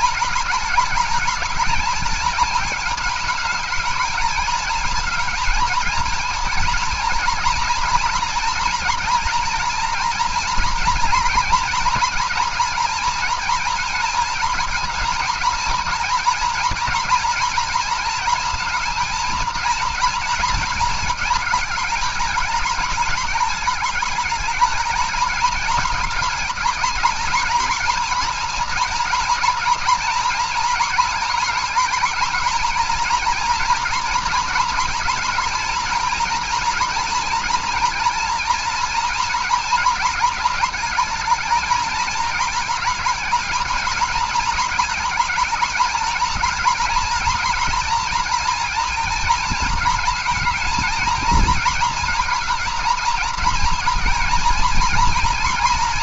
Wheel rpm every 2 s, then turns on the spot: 220, 210, 220, 230, 240, 230, 230, 230, 230, 230, 220, 210, 210, 220, 230, 230, 230, 230, 240, 230, 220, 220, 220, 230, 230, 220, 230, 230.
none